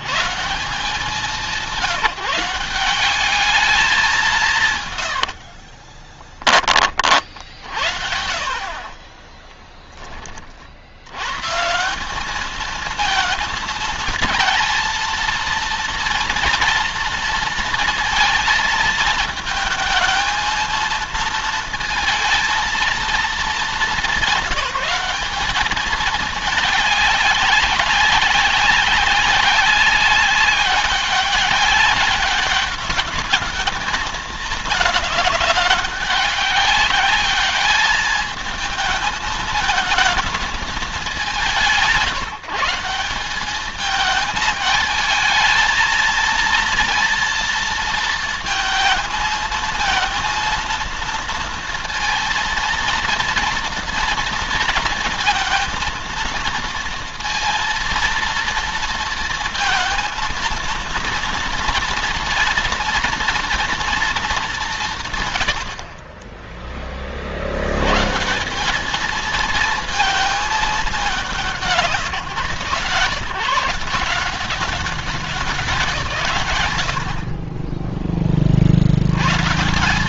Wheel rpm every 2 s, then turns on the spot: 180, 190, 130, 40, 30, 80, 230, 230, 230, 220, 220, 220, 190, 200, 200, 190, 200, 210, 200, 220, 200, 180, 220, 230, 220, 230, 240, 230, 230, 230, 230, 230, 150, 40, 220, 210, 140, 190, 60, 90.
4-6 8-10